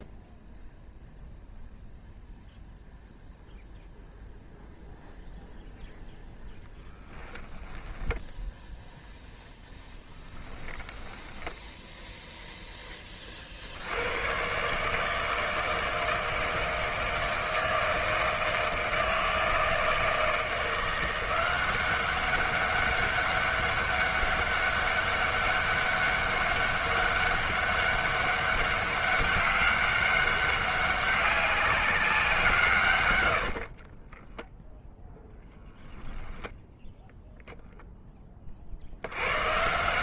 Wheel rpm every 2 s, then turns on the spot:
0, 0, 0, 10, 0, 10, 0, 130, 160, 160, 170, 200, 200, 200, 200, 200, 150, 0, 10, 50.
10-12